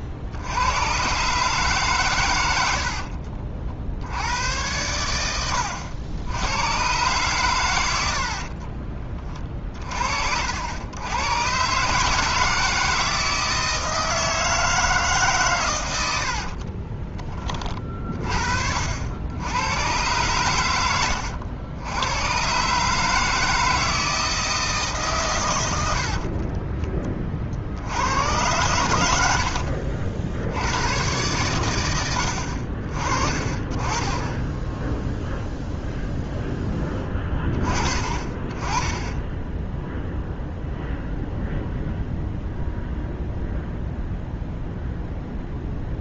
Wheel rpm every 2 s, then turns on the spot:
100, 80, 100, 110, 40, 80, 160, 160, 40, 60, 100, 130, 160, 30, 110, 60, 50, 0, 0, 20, 0, 0, 0.
2-4 8-10 16-18